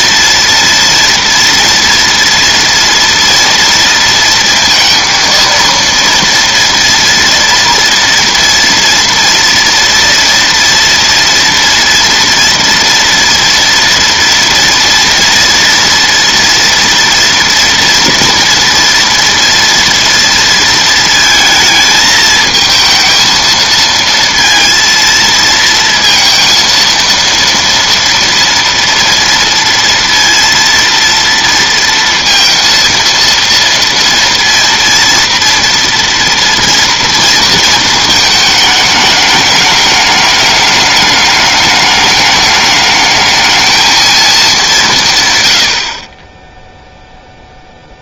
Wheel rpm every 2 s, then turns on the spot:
230, 230, 230, 230, 230, 230, 230, 230, 230, 230, 230, 220, 230, 230, 230, 230, 230, 230, 230, 210, 210, 210, 190, 0.
none